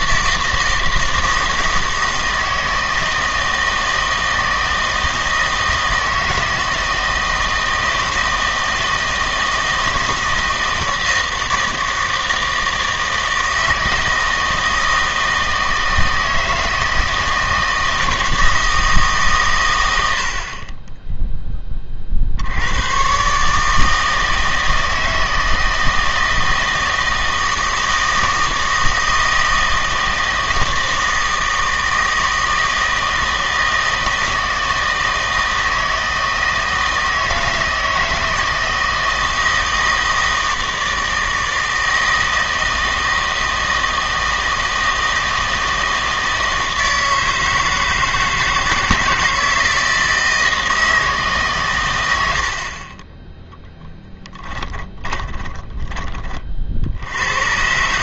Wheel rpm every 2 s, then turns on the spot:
160, 160, 160, 160, 160, 160, 160, 160, 160, 160, 20, 90, 160, 160, 160, 160, 160, 160, 160, 160, 160, 160, 160, 160, 160, 160, 50, 10, 70.
54-56